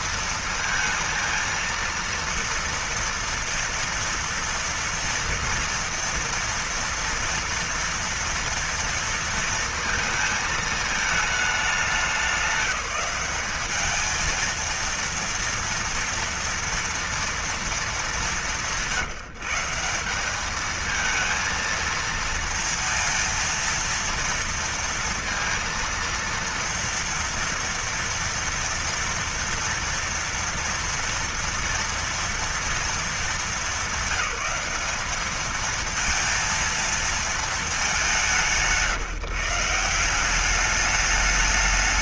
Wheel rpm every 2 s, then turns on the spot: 230, 230, 230, 230, 230, 220, 190, 230, 230, 190, 210, 230, 230, 230, 230, 230, 230, 200, 230, 180, 200.
none